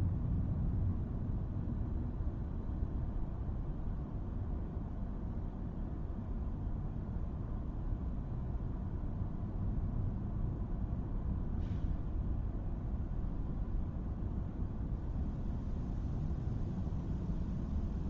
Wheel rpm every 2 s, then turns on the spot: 0, 0, 0, 0, 0, 0, 0, 0, 0.
none